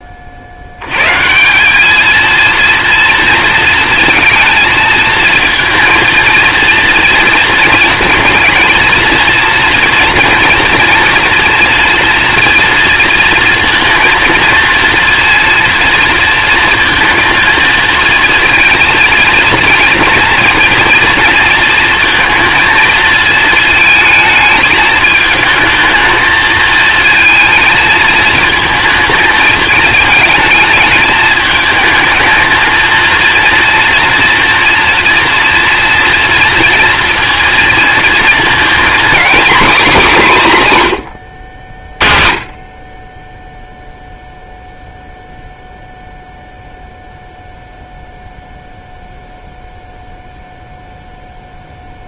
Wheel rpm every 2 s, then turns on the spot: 90, 230, 230, 230, 230, 240, 230, 230, 230, 230, 230, 230, 220, 220, 220, 220, 230, 230, 230, 240, 160, 40, 0, 0, 0, 0.
none